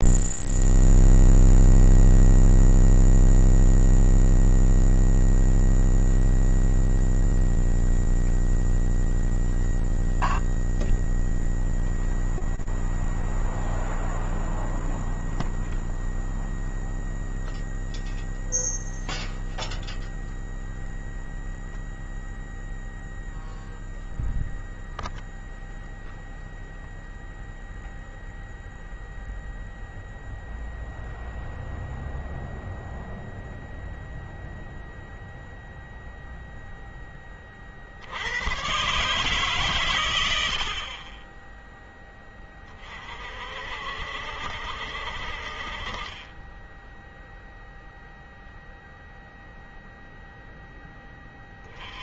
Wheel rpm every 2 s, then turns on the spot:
0, 0, 0, 0, 0, 0, 0, 0, 0, 0, 0, 0, 0, 0, 0, 0, 0, 0, 0, 130, 40, 30, 60, 10, 0, 10.
none